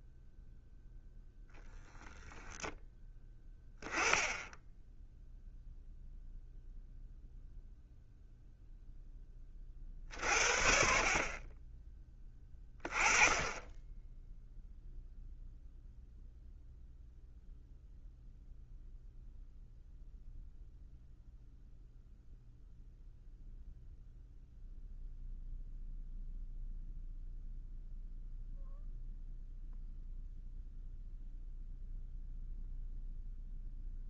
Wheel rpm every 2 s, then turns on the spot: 0, 10, 0, 0, 0, 50, 20, 0, 0, 0, 0, 0, 0, 0, 0, 0, 0.
none